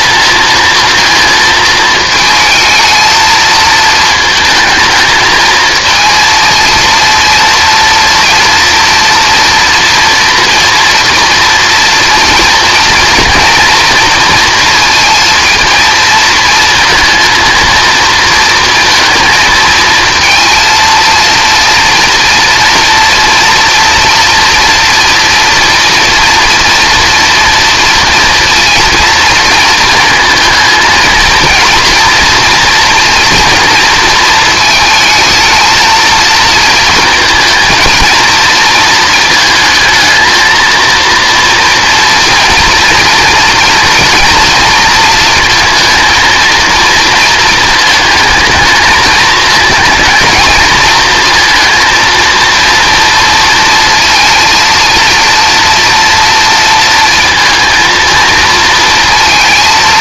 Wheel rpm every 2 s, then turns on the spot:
220, 220, 220, 230, 230, 230, 230, 230, 230, 230, 230, 230, 230, 230, 230, 240, 240, 220, 230, 220, 230, 230, 230, 230, 220, 220, 230, 230, 230, 230.
none